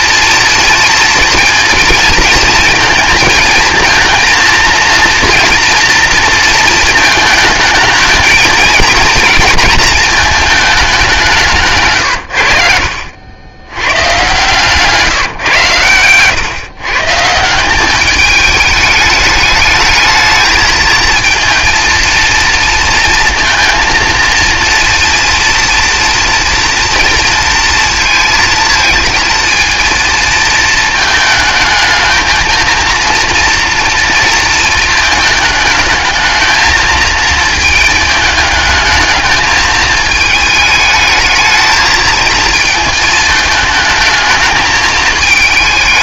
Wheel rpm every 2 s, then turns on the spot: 230, 230, 230, 220, 230, 200, 70, 150, 140, 210, 220, 230, 230, 230, 230, 230, 230, 220, 220, 220, 220, 220, 220.
none